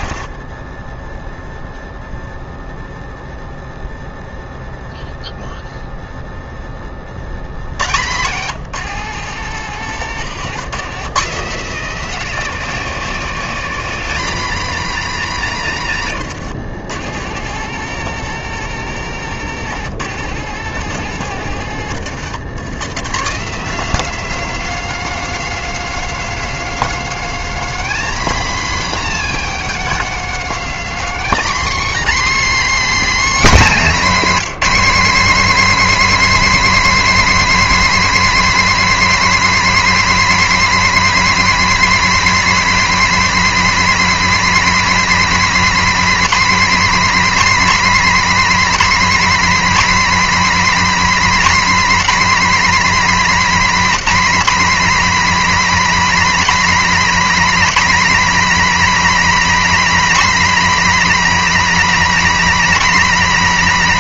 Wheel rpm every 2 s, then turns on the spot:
20, 0, 0, 10, 150, 150, 250, 250, 130, 140, 130, 140, 270, 270, 290, 270, 300, 270, 310, 310, 310, 310, 310, 280, 300, 300, 280, 270, 300, 300, 300, 300.
0-2 8-10 16-22